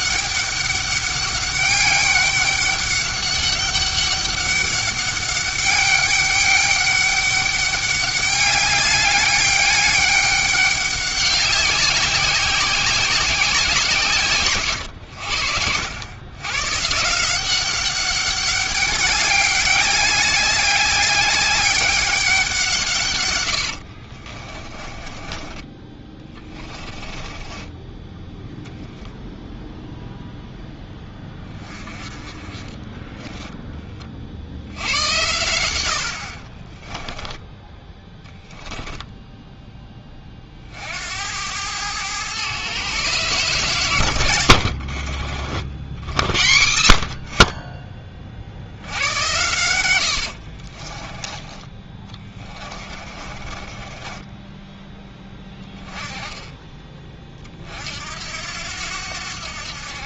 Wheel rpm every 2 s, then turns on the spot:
200, 200, 200, 200, 200, 200, 190, 120, 120, 200, 200, 170, 40, 20, 0, 10, 20, 80, 30, 10, 50, 130, 70, 80, 70, 40, 20, 10, 20, 80.
24-28 32-34 36-38 44-46 50-56